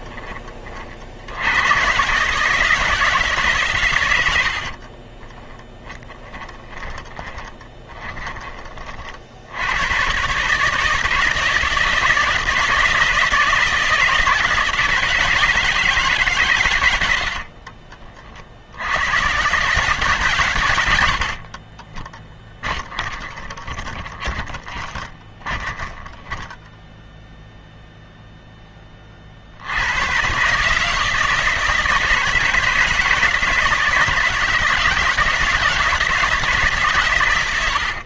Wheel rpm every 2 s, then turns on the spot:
50, 160, 60, 10, 40, 150, 160, 170, 100, 80, 100, 20, 30, 10, 20, 150, 150, 160, 140.
4-8 20-28